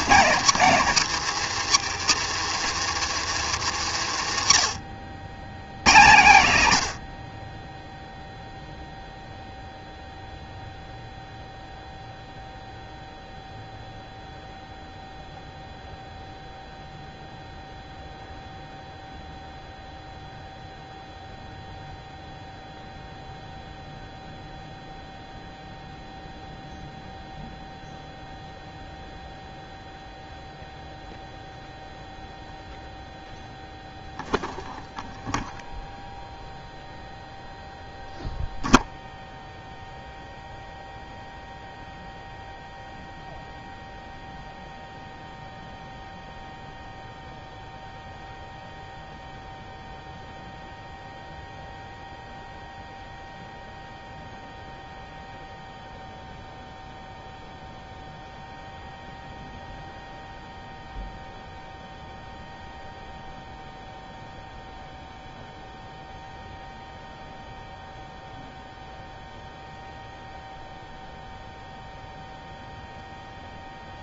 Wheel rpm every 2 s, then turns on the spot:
200, 170, 90, 120, 0, 0, 0, 0, 0, 0, 0, 0, 0, 0, 0, 0, 0, 0, 0, 0, 0, 0, 0, 0, 0, 0, 0, 0, 0, 0, 0, 0, 0, 0, 0, 0, 0.
none